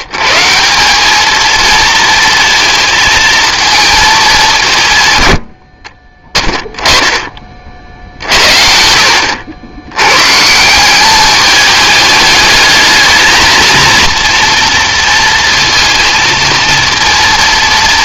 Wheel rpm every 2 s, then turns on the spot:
140, 230, 180, 10, 60, 150, 210, 230, 230.
none